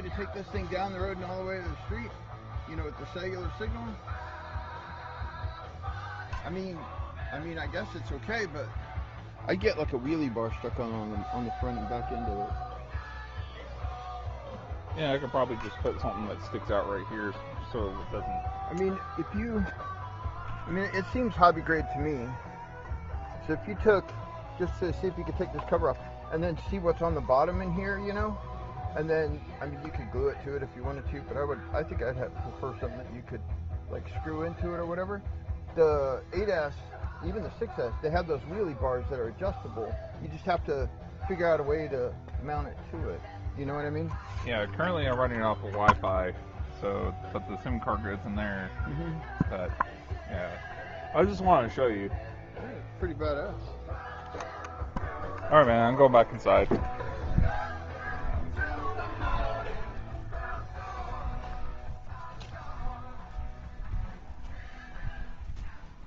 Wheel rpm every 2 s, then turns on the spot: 0, 0, 0, 0, 0, 0, 0, 0, 0, 0, 0, 0, 0, 0, 0, 0, 0, 0, 0, 0, 0, 0, 0, 0, 0, 0, 0, 0, 0, 0, 0, 0, 0.
none